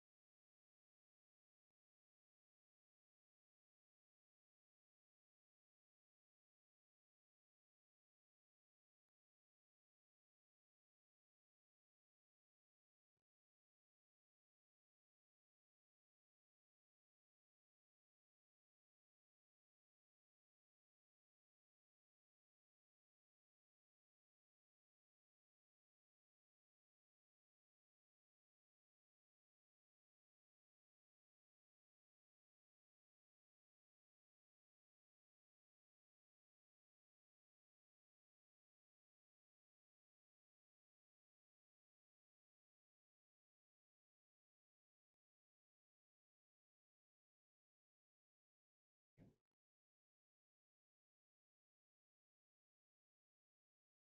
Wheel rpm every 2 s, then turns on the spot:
0, 0, 0, 0, 0, 0, 0, 0, 0, 0, 0, 0, 0, 0, 0, 0, 0, 0, 0, 0, 0, 0, 0, 0, 0, 0, 0.
none